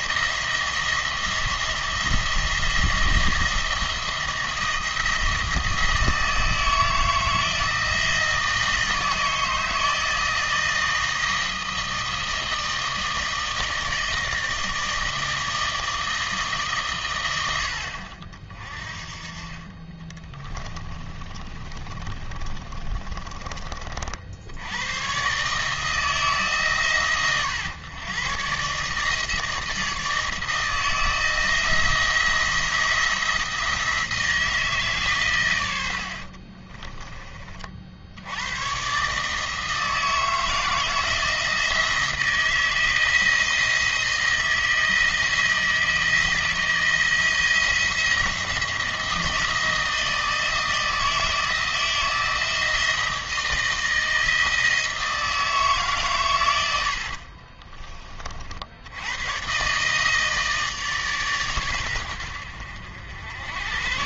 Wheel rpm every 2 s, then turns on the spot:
170, 170, 170, 160, 160, 160, 160, 160, 140, 40, 20, 30, 90, 140, 140, 160, 170, 150, 30, 120, 160, 170, 170, 160, 170, 160, 170, 160, 90, 80, 150, 70.
20-24 36-38